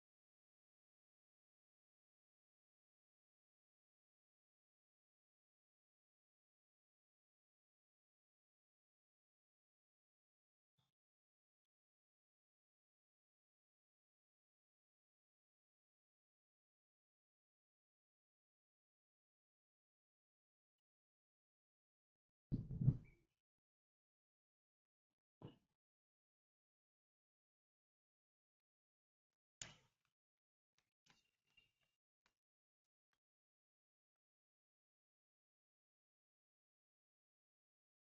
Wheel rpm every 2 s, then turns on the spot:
0, 0, 0, 0, 0, 0, 0, 0, 0, 0, 0, 0, 0, 0, 0, 0, 0, 0, 0.
none